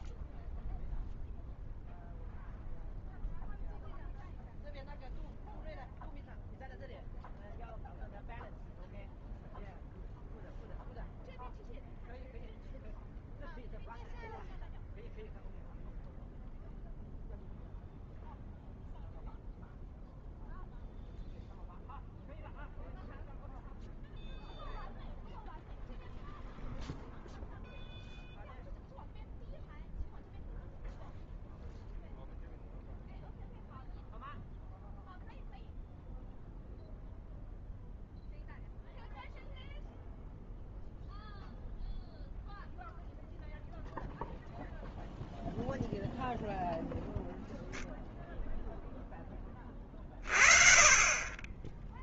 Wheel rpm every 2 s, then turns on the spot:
0, 0, 0, 0, 0, 0, 0, 0, 0, 0, 0, 0, 0, 0, 0, 0, 0, 0, 0, 0, 0, 0, 0, 0, 0, 40.
none